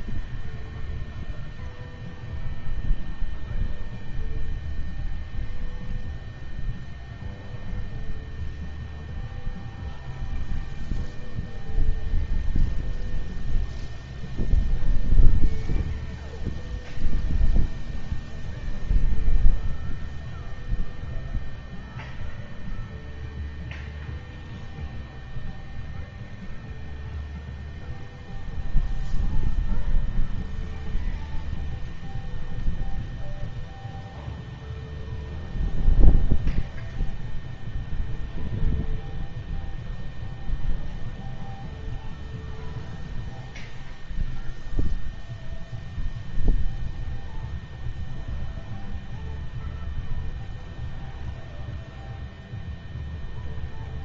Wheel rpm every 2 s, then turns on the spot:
0, 0, 0, 0, 0, 0, 0, 0, 0, 0, 0, 0, 0, 0, 0, 0, 0, 0, 0, 0, 0, 0, 0, 0, 0, 0, 0.
none